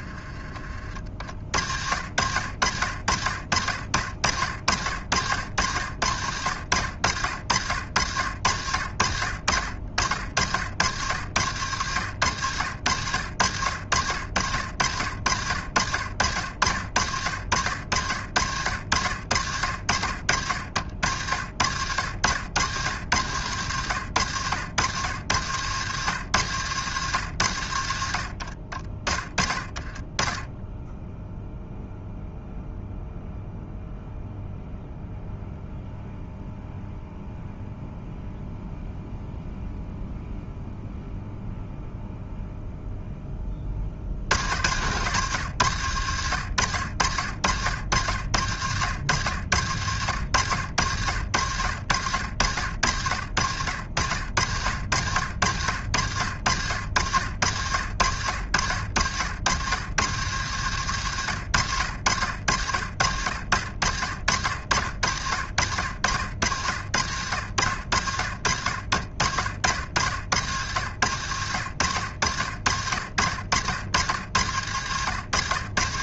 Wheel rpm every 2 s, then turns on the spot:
30, 60, 60, 70, 70, 70, 90, 80, 70, 70, 70, 90, 90, 110, 50, 20, 0, 0, 0, 0, 0, 0, 80, 80, 80, 80, 80, 80, 70, 70, 110, 70, 70, 80, 70, 80, 70, 80.
none